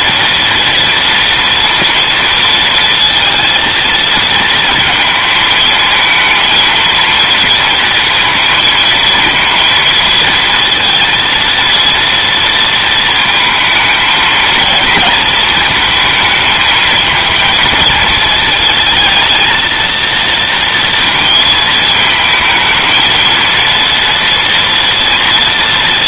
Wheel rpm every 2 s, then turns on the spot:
230, 230, 230, 230, 230, 230, 230, 220, 220, 220, 230, 220, 230.
none